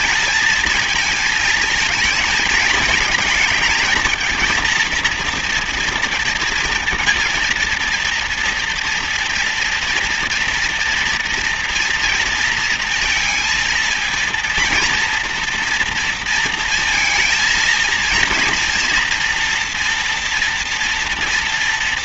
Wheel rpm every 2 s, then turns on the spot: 220, 220, 220, 230, 240, 230, 230, 230, 230, 230, 230.
none